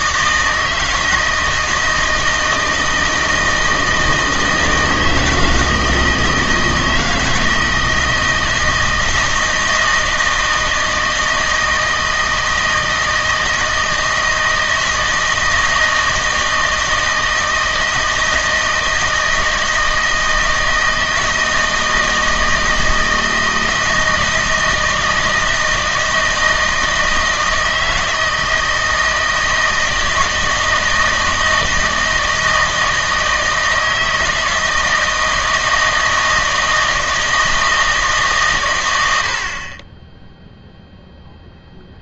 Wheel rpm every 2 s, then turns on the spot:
160, 160, 160, 160, 160, 160, 160, 160, 160, 160, 160, 160, 160, 160, 160, 160, 160, 160, 160, 110, 0.
none